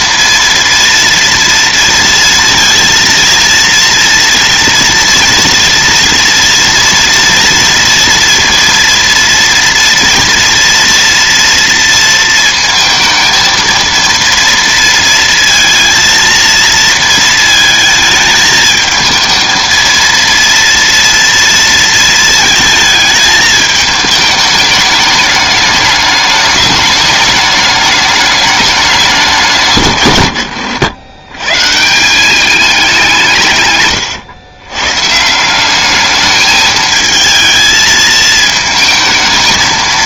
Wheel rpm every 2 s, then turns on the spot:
230, 230, 230, 230, 230, 230, 230, 230, 230, 220, 230, 220, 210, 210, 210, 100, 200, 120, 220, 220.
none